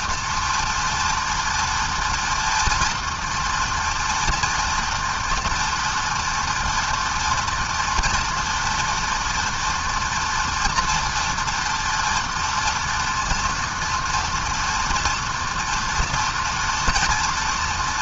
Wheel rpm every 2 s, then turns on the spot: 240, 230, 230, 230, 230, 230, 240, 230, 230.
none